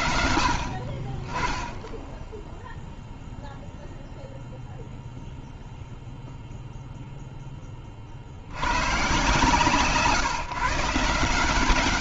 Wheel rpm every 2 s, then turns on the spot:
60, 0, 0, 30, 140, 150.
none